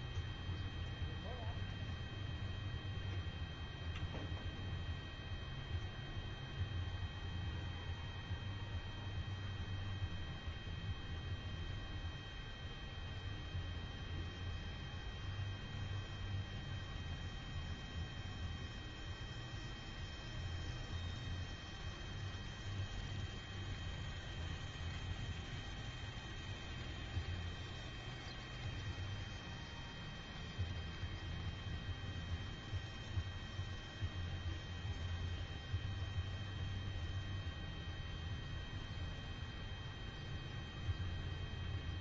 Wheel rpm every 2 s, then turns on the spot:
0, 0, 0, 0, 0, 0, 0, 0, 0, 0, 0, 0, 0, 0, 0, 0, 0, 0, 0, 0, 0.
none